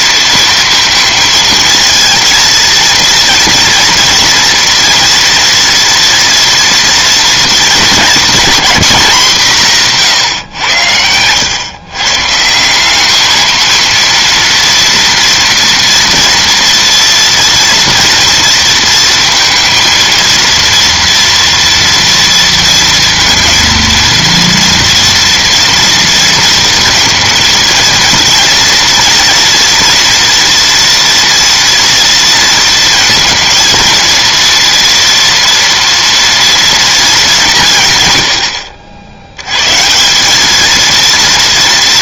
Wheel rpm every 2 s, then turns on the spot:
230, 230, 230, 230, 230, 100, 190, 230, 230, 230, 230, 230, 230, 230, 230, 230, 230, 230, 230, 70, 220.
none